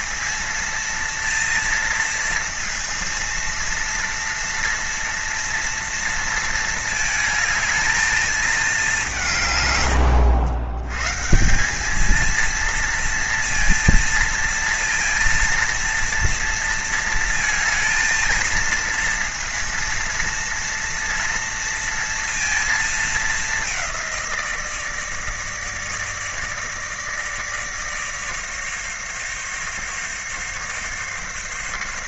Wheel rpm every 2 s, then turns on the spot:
230, 230, 230, 220, 200, 110, 230, 230, 230, 230, 230, 220, 160, 150, 150, 140.
none